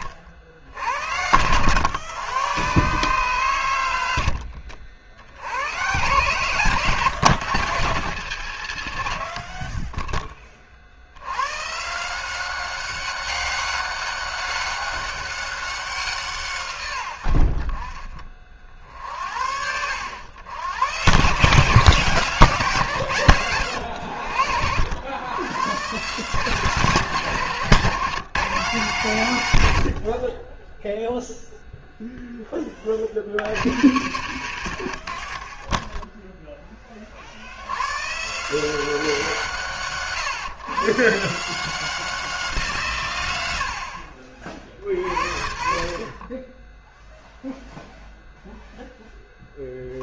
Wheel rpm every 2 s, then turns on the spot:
50, 130, 50, 130, 120, 40, 190, 200, 120, 40, 90, 160, 90, 150, 170, 10, 20, 100, 20, 170, 130, 150, 70, 10, 10.
none